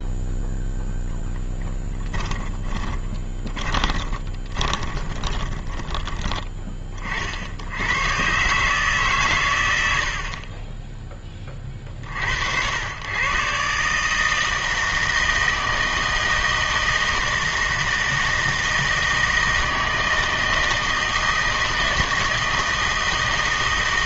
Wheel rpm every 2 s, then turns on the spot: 0, 30, 30, 20, 140, 30, 80, 160, 160, 160, 160, 160.
2-6